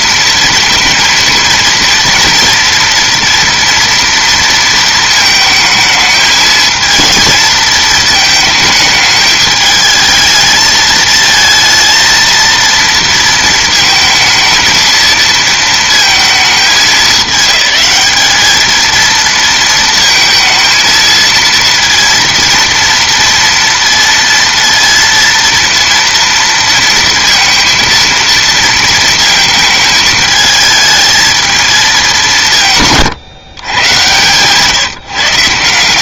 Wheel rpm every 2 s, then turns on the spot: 230, 230, 230, 220, 220, 220, 230, 230, 220, 220, 230, 230, 230, 230, 230, 220, 170, 140.
none